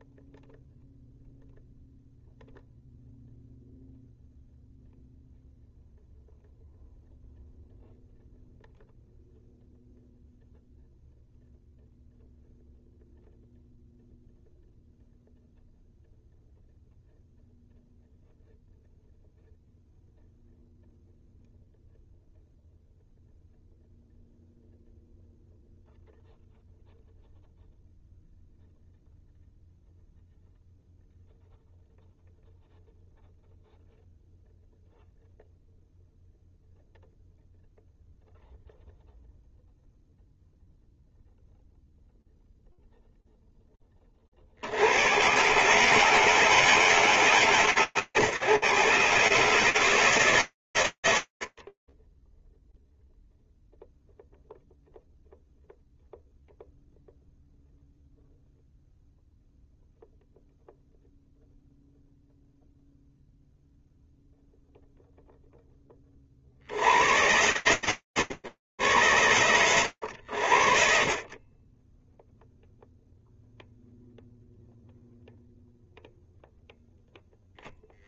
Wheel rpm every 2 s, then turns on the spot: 0, 0, 0, 0, 0, 0, 0, 0, 0, 0, 0, 0, 0, 0, 0, 0, 0, 0, 0, 0, 0, 0, 80, 160, 140, 120, 0, 0, 0, 0, 0, 0, 0, 110, 90, 30, 0, 0, 40.
70-72